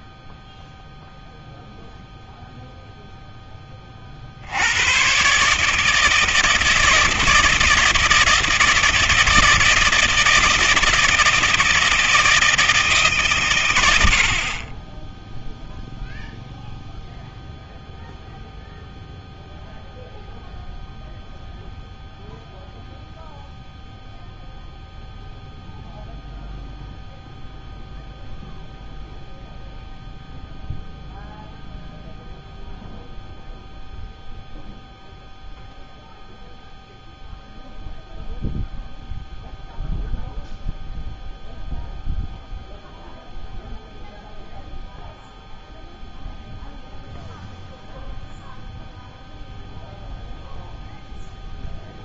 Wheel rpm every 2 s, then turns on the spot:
0, 0, 70, 160, 160, 160, 160, 40, 0, 0, 0, 0, 0, 0, 0, 0, 0, 0, 0, 0, 0, 0, 0, 0, 0, 0.
none